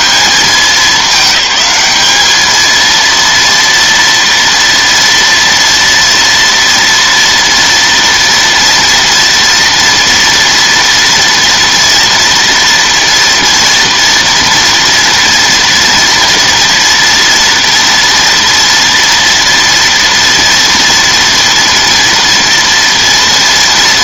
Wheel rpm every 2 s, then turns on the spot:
210, 220, 230, 230, 230, 230, 230, 230, 230, 230, 230, 230.
none